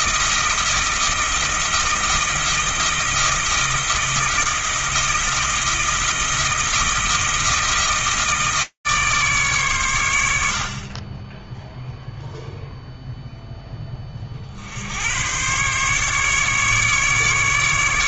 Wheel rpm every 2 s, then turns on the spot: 160, 160, 160, 160, 150, 30, 0, 80, 150.
none